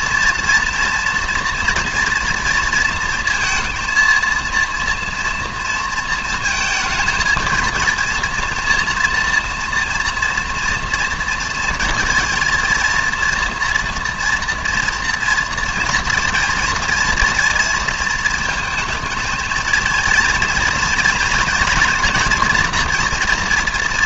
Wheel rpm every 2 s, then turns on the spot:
230, 230, 230, 220, 230, 230, 230, 230, 230, 220, 230, 240.
none